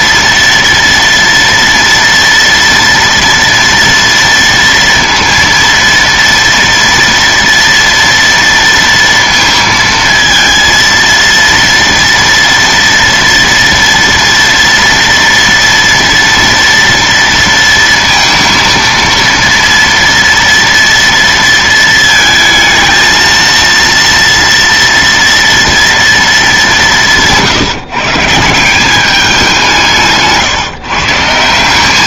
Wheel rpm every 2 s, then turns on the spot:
230, 230, 230, 230, 230, 230, 230, 230, 230, 230, 230, 220, 230, 210, 170, 160.
none